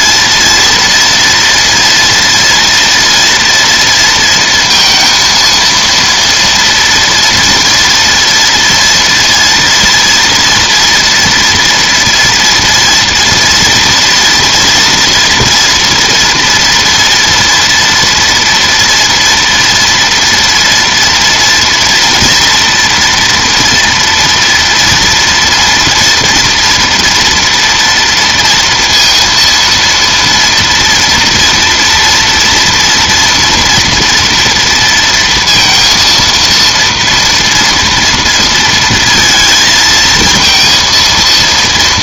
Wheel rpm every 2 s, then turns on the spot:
230, 230, 230, 230, 230, 240, 230, 230, 230, 230, 230, 230, 230, 230, 230, 230, 240, 230, 230, 230, 230.
none